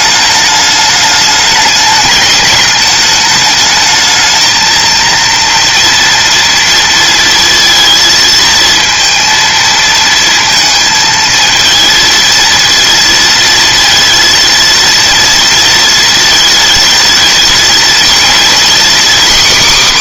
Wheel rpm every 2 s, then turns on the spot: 210, 210, 230, 230, 230, 230, 230, 230, 230, 260.
none